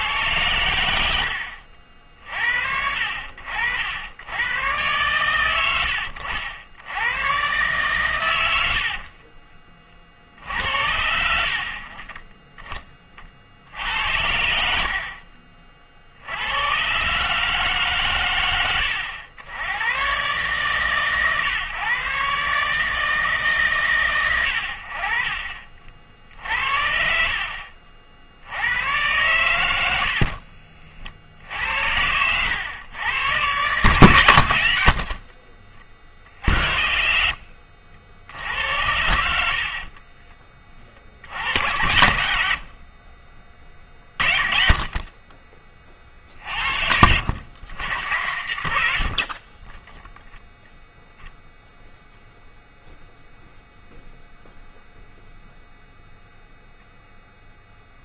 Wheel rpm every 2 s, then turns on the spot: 80, 60, 120, 90, 70, 70, 10, 70, 110, 100, 140, 150, 80, 60, 90, 50, 100, 80, 60, 80, 40, 60, 40, 50, 100, 0, 0, 0, 0.
8-10 30-32 38-40